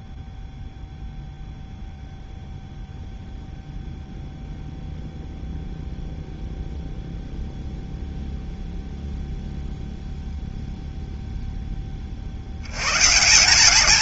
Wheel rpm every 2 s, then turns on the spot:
0, 0, 0, 0, 0, 0, 70.
none